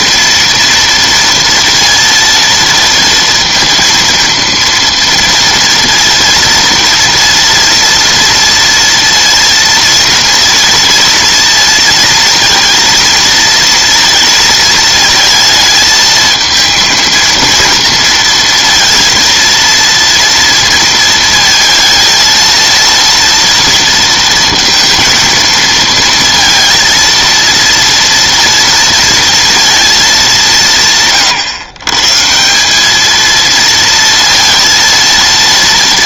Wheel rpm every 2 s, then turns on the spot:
230, 230, 230, 230, 230, 230, 230, 230, 230, 230, 230, 230, 230, 230, 230, 170, 190, 230.
none